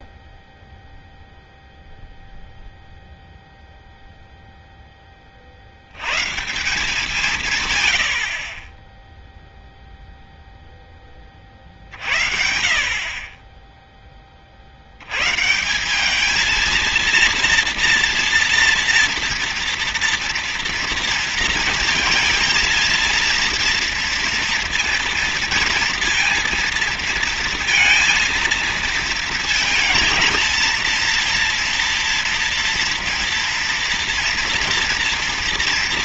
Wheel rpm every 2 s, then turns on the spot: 0, 0, 0, 150, 30, 0, 60, 50, 220, 240, 230, 230, 230, 230, 220, 220, 230, 230.
none